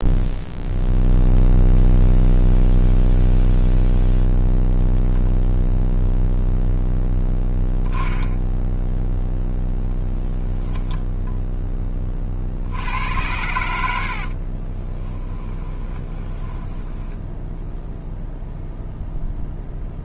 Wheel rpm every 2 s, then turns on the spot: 0, 0, 0, 0, 0, 10, 70, 20, 10, 0.
14-18